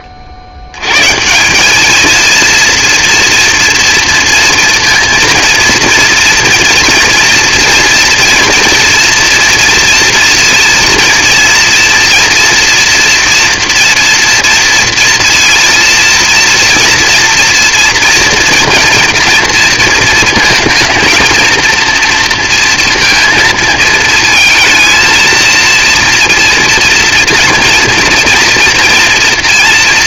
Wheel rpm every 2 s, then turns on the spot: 60, 230, 230, 230, 230, 230, 230, 230, 230, 230, 230, 230, 220, 230, 230.
none